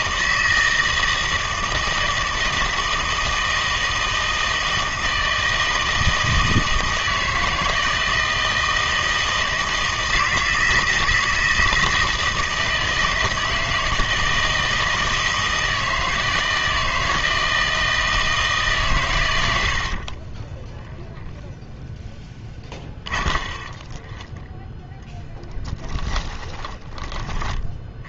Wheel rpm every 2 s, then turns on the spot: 160, 160, 160, 160, 160, 160, 160, 160, 160, 150, 10, 20, 10, 10.
20-28